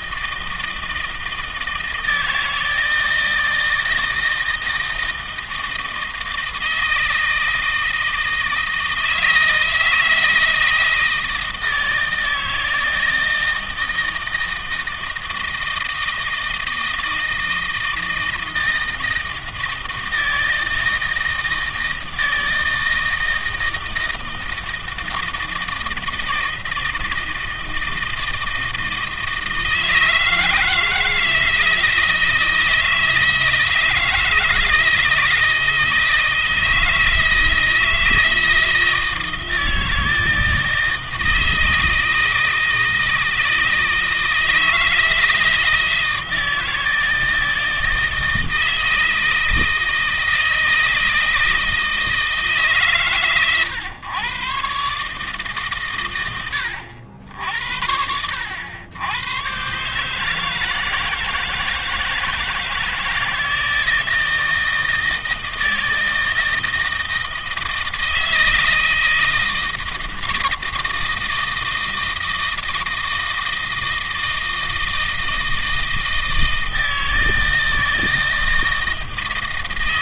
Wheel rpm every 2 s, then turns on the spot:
160, 160, 160, 160, 160, 160, 160, 160, 160, 160, 160, 160, 160, 160, 160, 160, 160, 160, 160, 160, 160, 160, 160, 160, 160, 160, 140, 140, 80, 90, 160, 160, 160, 160, 160, 160, 160, 160, 160, 160.
none